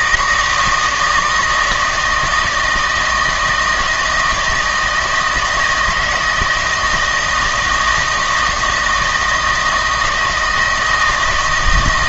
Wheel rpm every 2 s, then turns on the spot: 160, 160, 160, 160, 160, 160.
none